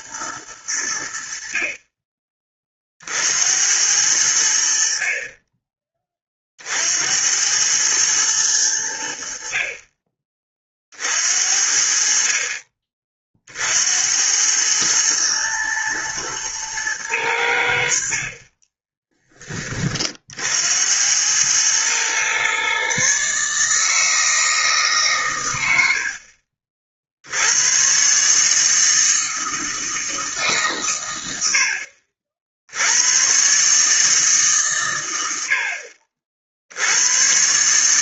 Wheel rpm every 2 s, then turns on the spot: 100, 30, 70, 50, 100, 40, 40, 100, 110, 30, 70, 130, 160, 50, 150, 140, 70, 140, 60.
18-20